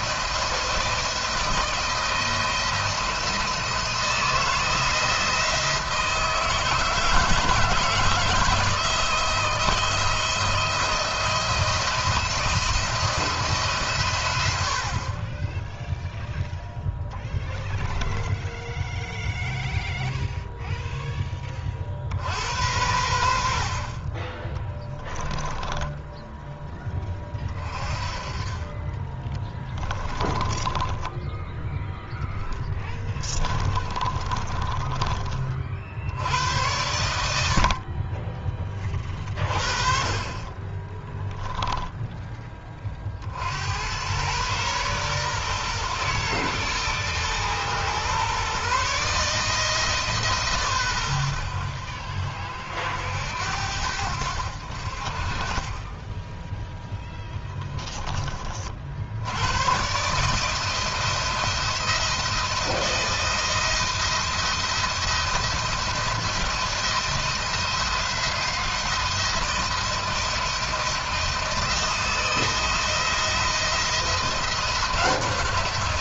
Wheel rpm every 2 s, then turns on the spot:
170, 170, 170, 160, 160, 160, 170, 90, 0, 10, 0, 70, 20, 10, 40, 20, 20, 20, 90, 20, 30, 30, 120, 110, 140, 130, 50, 60, 10, 30, 150, 160, 170, 160, 160, 170, 170, 170.
18-20 24-26 30-36 40-42